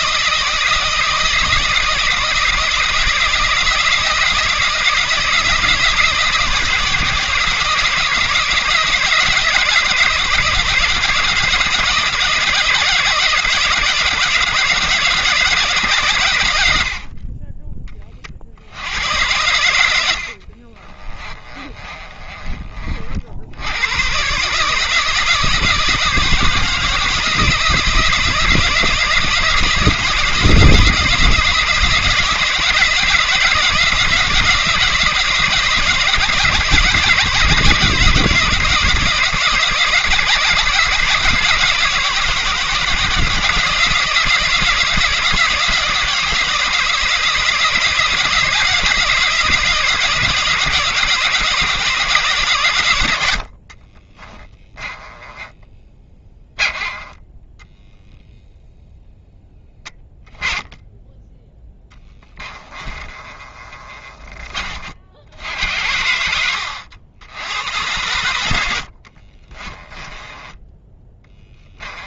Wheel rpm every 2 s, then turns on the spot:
160, 160, 170, 160, 160, 160, 170, 160, 50, 90, 30, 50, 160, 160, 160, 160, 150, 160, 160, 160, 160, 160, 160, 170, 170, 170, 90, 10, 10, 0, 10, 20, 70, 80, 60, 10.
20-22 62-64 68-70